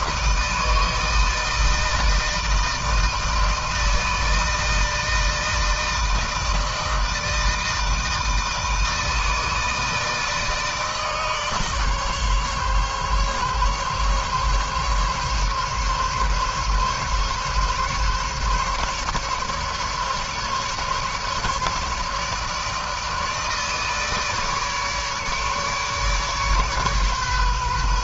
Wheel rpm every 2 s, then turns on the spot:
160, 160, 160, 160, 160, 150, 140, 140, 140, 150, 140, 150, 150, 140.
none